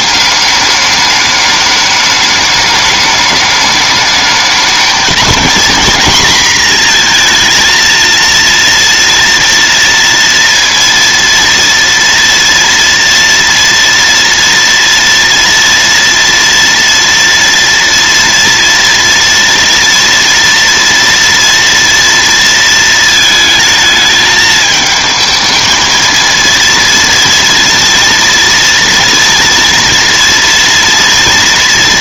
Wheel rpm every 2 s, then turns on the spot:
200, 210, 220, 230, 230, 230, 240, 230, 240, 240, 230, 230, 220, 230, 230, 240.
none